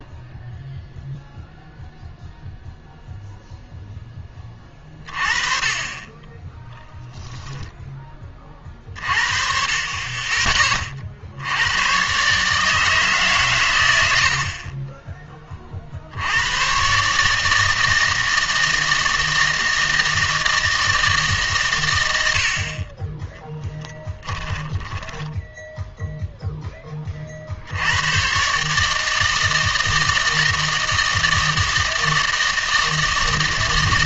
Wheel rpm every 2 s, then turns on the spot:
0, 0, 20, 10, 30, 20, 150, 50, 100, 160, 160, 70, 20, 10, 140, 160, 160.
24-26